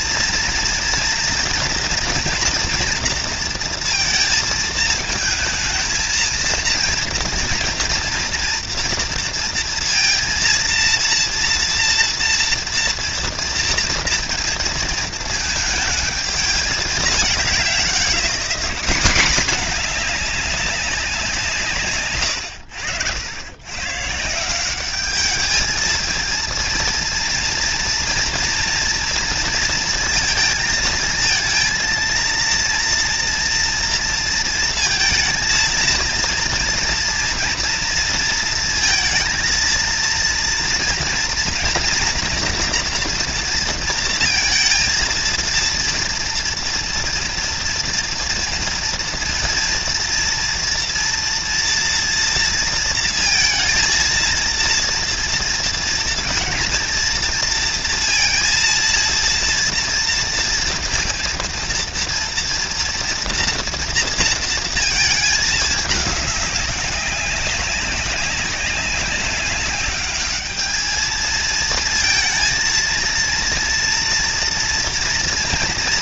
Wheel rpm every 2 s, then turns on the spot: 230, 230, 220, 230, 230, 230, 230, 230, 210, 210, 190, 80, 200, 230, 230, 230, 230, 220, 230, 230, 230, 230, 230, 240, 240, 230, 230, 230, 230, 230, 230, 230, 220, 200, 200, 220, 230, 230.
none